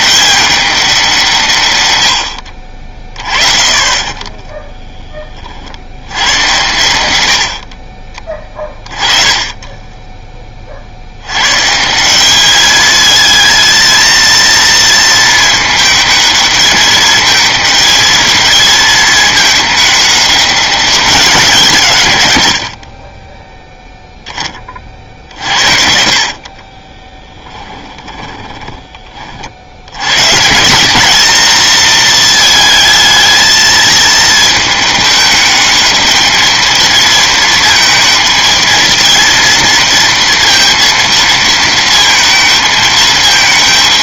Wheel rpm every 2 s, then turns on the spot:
190, 40, 10, 90, 20, 60, 220, 220, 210, 220, 200, 50, 30, 30, 20, 180, 220, 220, 220, 230, 230, 220.
2-4 26-30